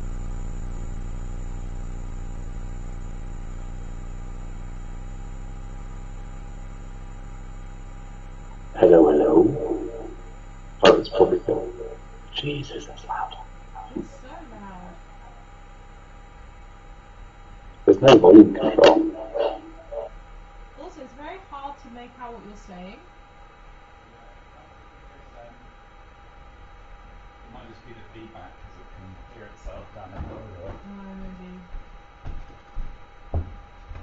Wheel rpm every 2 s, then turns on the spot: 0, 0, 0, 0, 0, 0, 0, 0, 0, 0, 0, 0, 0, 0, 0, 0, 0.
none